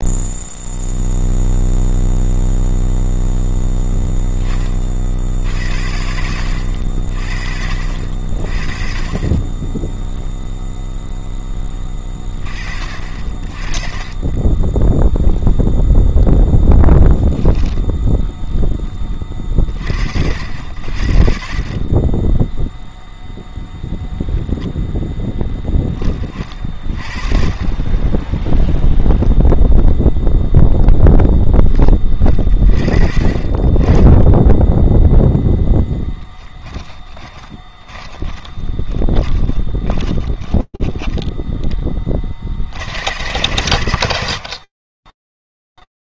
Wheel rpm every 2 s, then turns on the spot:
0, 0, 20, 80, 40, 0, 30, 10, 0, 10, 70, 0, 0, 40, 10, 0, 30, 10, 10, 20, 10, 90, 30.
28-30 36-42